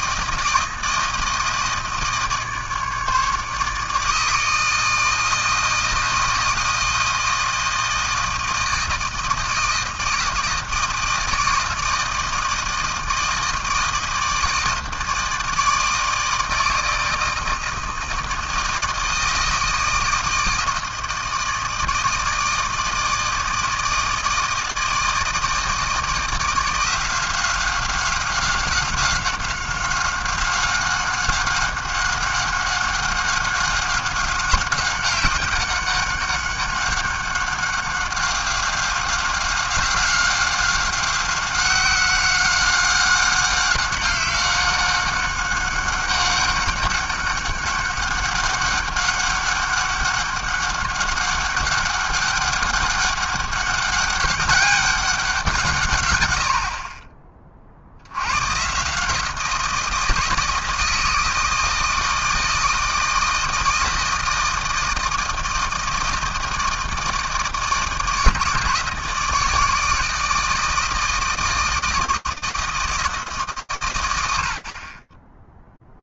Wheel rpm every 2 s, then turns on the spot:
160, 150, 160, 160, 160, 160, 160, 160, 160, 160, 160, 160, 160, 170, 190, 190, 190, 190, 200, 190, 190, 190, 190, 200, 200, 200, 200, 200, 40, 150, 160, 160, 160, 160, 150, 160, 160, 50.
none